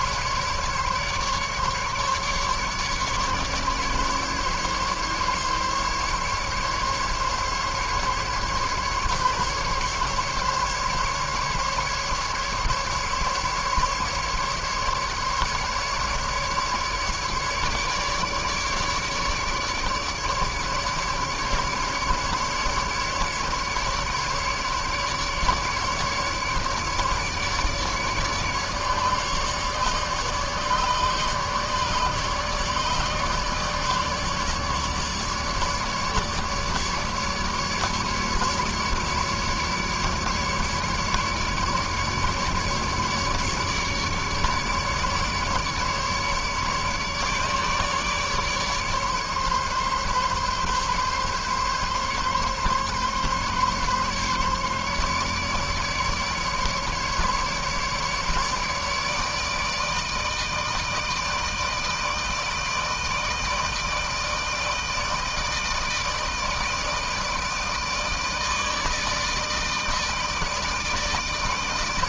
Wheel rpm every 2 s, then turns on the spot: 140, 150, 140, 140, 140, 140, 150, 150, 150, 150, 150, 150, 150, 150, 150, 150, 150, 150, 150, 150, 150, 150, 150, 150, 150, 140, 140, 140, 150, 150, 160, 160, 160, 160, 160, 160.
none